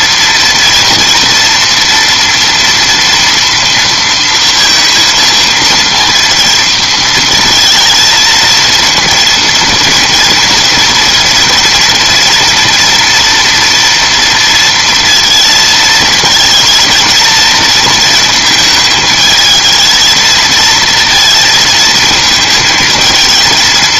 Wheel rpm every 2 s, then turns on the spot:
230, 230, 230, 230, 230, 230, 230, 230, 220, 220, 230, 220.
none